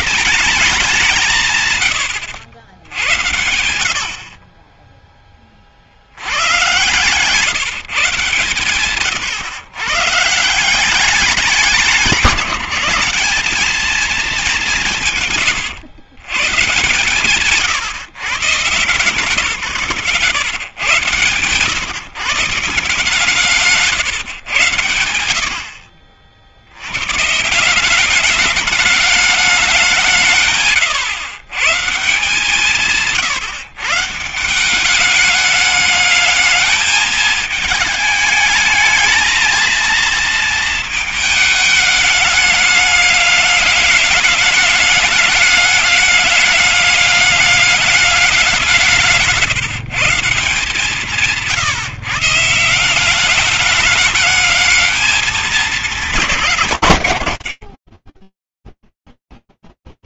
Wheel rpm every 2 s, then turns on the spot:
180, 60, 0, 130, 130, 180, 180, 170, 140, 150, 120, 150, 110, 100, 210, 120, 150, 190, 220, 220, 220, 210, 210, 200, 180, 160, 180, 220, 110, 0.
6-8